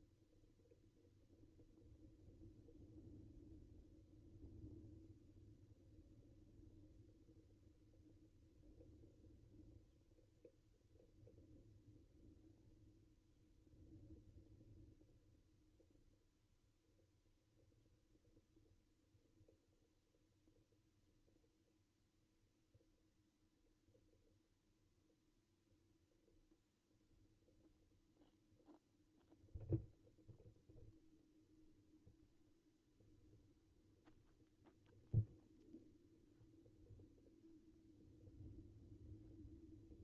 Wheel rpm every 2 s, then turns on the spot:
0, 0, 0, 0, 0, 0, 0, 0, 0, 0, 0, 0, 0, 0, 0, 0, 0, 0, 0, 0.
none